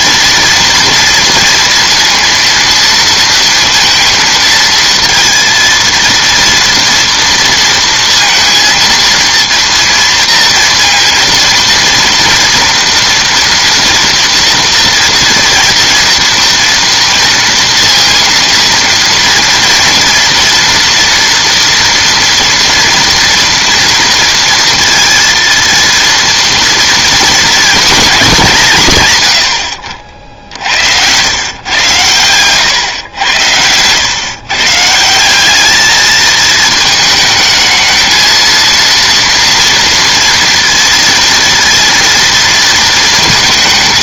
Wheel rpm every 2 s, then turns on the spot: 230, 230, 230, 230, 230, 230, 230, 230, 230, 230, 230, 240, 230, 240, 180, 70, 120, 140, 220, 230, 230, 230.
none